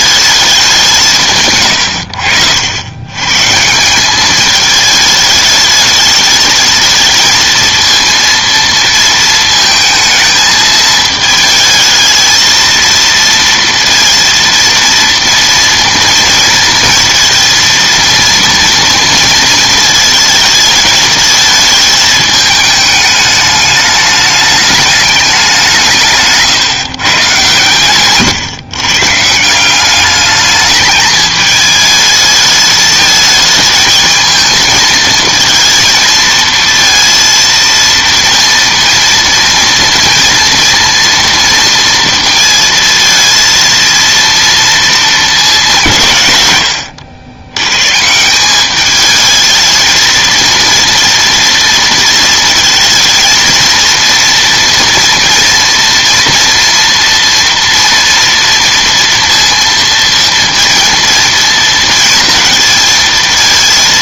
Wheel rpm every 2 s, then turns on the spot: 190, 90, 210, 220, 230, 220, 230, 230, 230, 230, 220, 210, 210, 150, 140, 210, 220, 220, 230, 230, 230, 230, 230, 100, 200, 230, 220, 240, 230, 230, 230, 230.
none